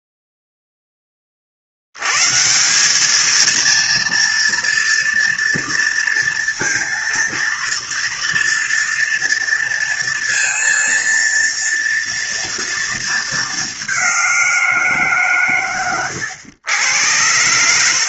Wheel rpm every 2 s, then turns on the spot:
0, 140, 230, 230, 230, 230, 230, 180, 100.
none